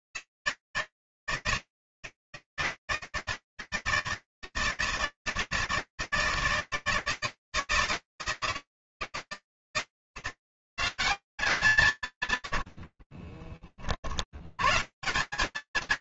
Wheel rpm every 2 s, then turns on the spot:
160, 160, 160, 160, 160, 180, 110, 70.
12-14